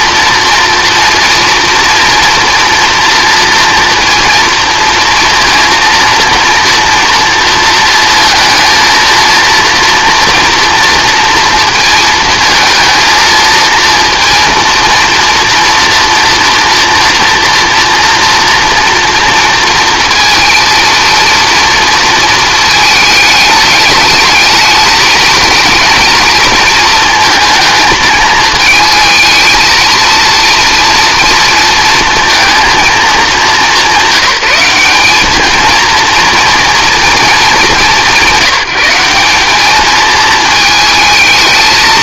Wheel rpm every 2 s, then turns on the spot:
230, 230, 230, 230, 230, 230, 230, 230, 230, 230, 230, 220, 220, 230, 220, 230, 230, 200, 230, 190, 220.
none